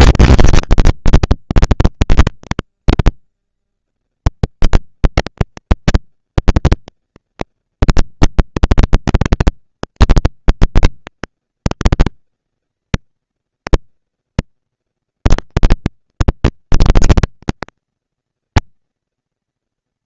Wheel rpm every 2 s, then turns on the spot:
220, 200, 200, 200, 220, 230, 220, 230, 230, 230.
none